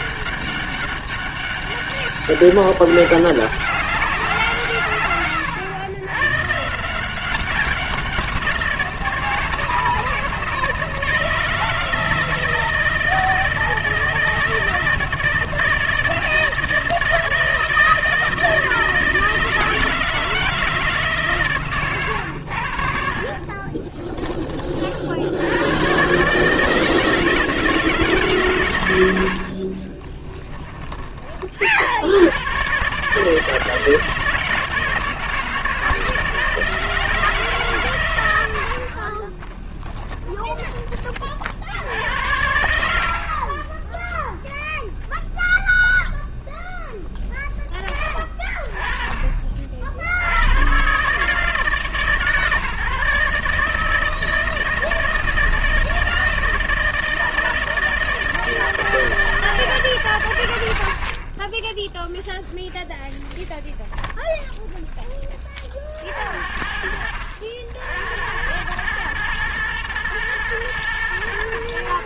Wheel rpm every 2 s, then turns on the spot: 200, 200, 160, 140, 180, 160, 160, 160, 160, 160, 160, 90, 30, 150, 140, 10, 110, 160, 160, 100, 20, 80, 0, 0, 30, 80, 150, 170, 160, 160, 90, 0, 0, 60, 100, 120.
30-32 40-42